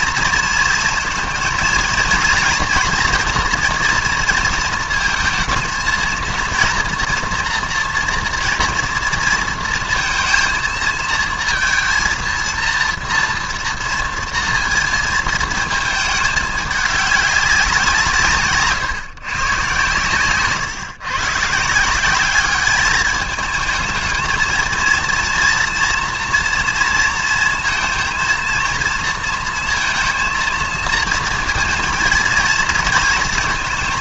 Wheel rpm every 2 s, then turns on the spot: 230, 230, 230, 230, 230, 230, 230, 230, 210, 150, 130, 200, 220, 230, 230, 230, 230.
none